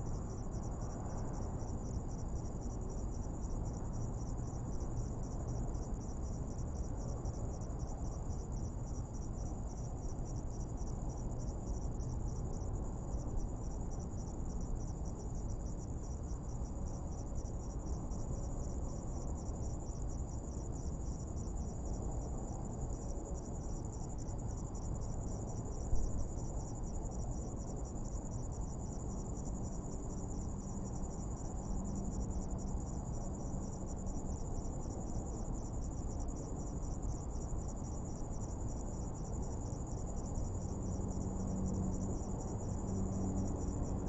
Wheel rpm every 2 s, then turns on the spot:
0, 0, 0, 0, 0, 0, 0, 0, 0, 0, 0, 0, 0, 0, 0, 0, 0, 0, 0, 0, 0, 0.
none